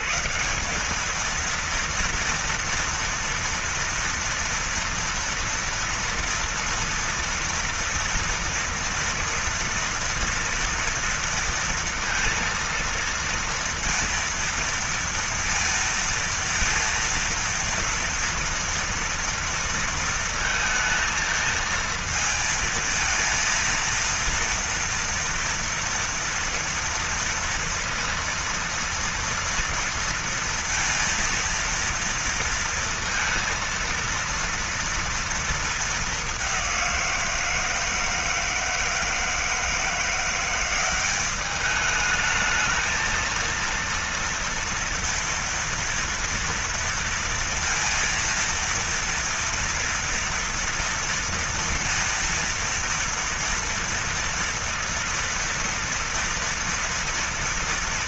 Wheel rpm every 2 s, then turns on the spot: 140, 230, 230, 230, 230, 230, 230, 230, 230, 230, 230, 220, 230, 230, 230, 230, 230, 230, 210, 160, 170, 210, 230, 230, 230, 230, 230, 230, 240.
none